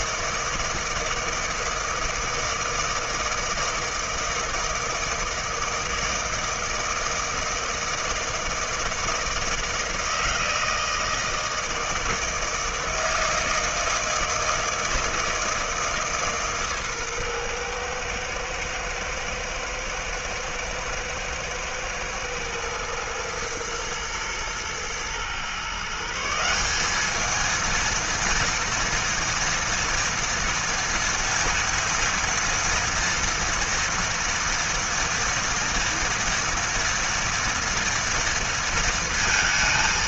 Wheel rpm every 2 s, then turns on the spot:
160, 160, 160, 160, 160, 160, 160, 160, 120, 110, 110, 120, 140, 230, 230, 230, 230, 240, 230, 230.
none